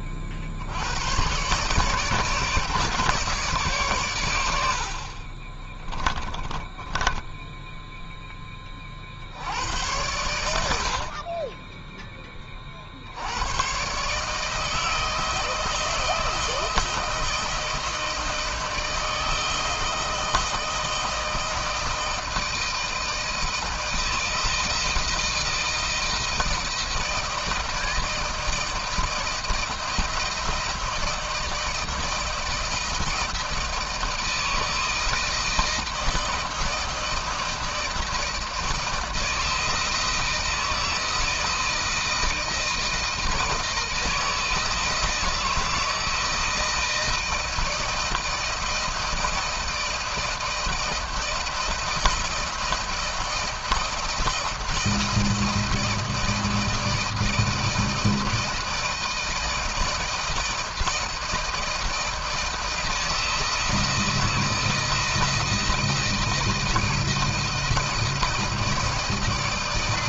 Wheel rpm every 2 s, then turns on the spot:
60, 150, 80, 20, 20, 70, 30, 160, 160, 160, 160, 160, 160, 160, 160, 170, 160, 160, 160, 160, 160, 160, 160, 160, 160, 160, 160, 170, 160, 160, 160, 170, 160, 160, 160.
4-8